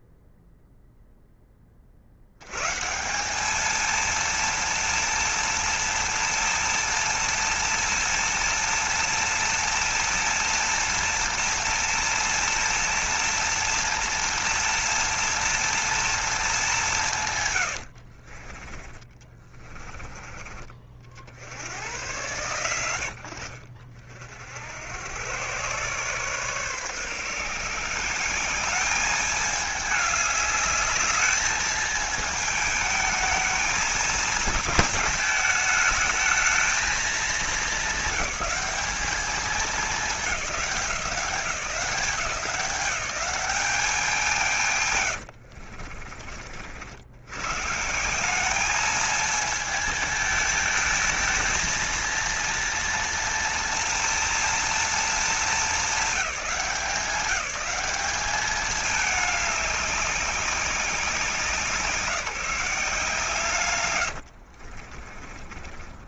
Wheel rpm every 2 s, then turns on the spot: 0, 110, 230, 230, 230, 230, 230, 230, 210, 40, 40, 110, 70, 140, 190, 210, 220, 220, 220, 200, 180, 180, 140, 60, 200, 220, 230, 230, 190, 210, 190, 170, 50.
64-66